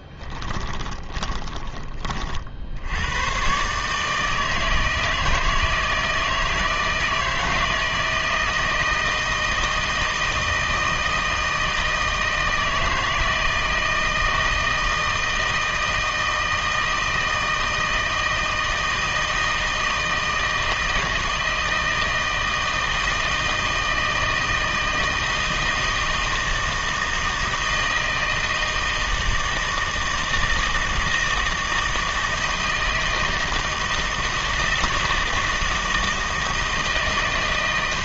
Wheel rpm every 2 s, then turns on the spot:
20, 70, 160, 160, 160, 160, 160, 160, 160, 160, 160, 160, 160, 160, 170, 160, 160, 160, 160.
0-2